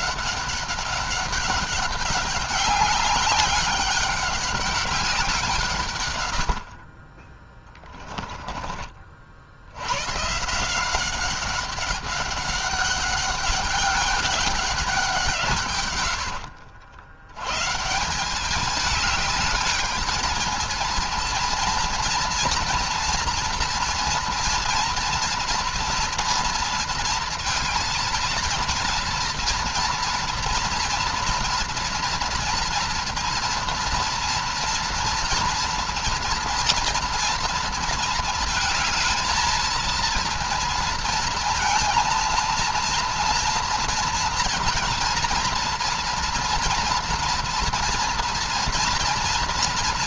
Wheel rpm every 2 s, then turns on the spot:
200, 200, 190, 40, 40, 170, 200, 190, 90, 210, 230, 230, 230, 230, 230, 240, 230, 230, 230, 220, 230, 230, 230, 230, 230.
6-8